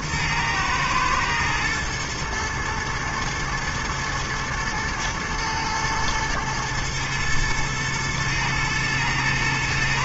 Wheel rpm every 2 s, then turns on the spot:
110, 110, 110, 120, 110.
none